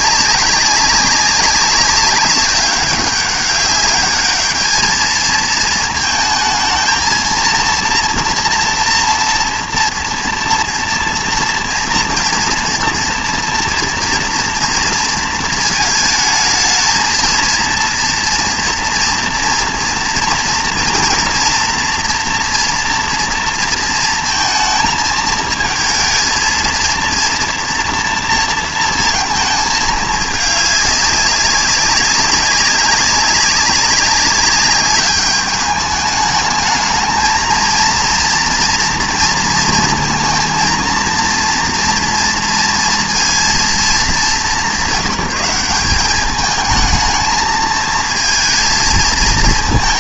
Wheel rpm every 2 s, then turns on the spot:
200, 190, 220, 220, 230, 230, 230, 230, 220, 230, 230, 230, 220, 230, 230, 210, 200, 200, 220, 230, 230, 230, 190, 220, 210.
none